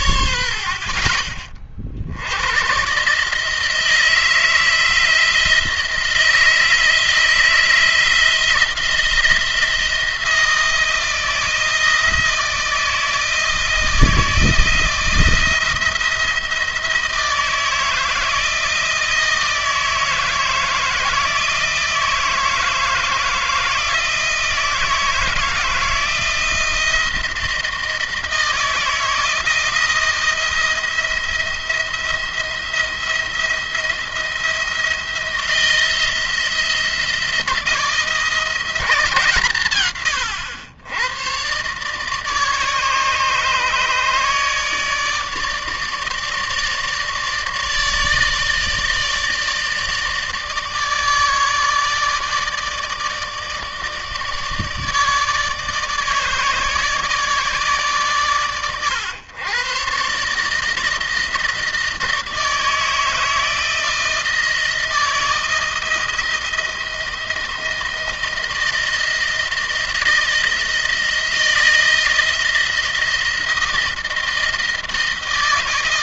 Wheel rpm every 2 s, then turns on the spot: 70, 100, 170, 160, 170, 170, 170, 170, 160, 160, 160, 160, 160, 160, 160, 170, 170, 170, 170, 180, 100, 150, 150, 150, 160, 150, 160, 160, 150, 110, 150, 160, 160, 160, 160, 170, 160, 160.
none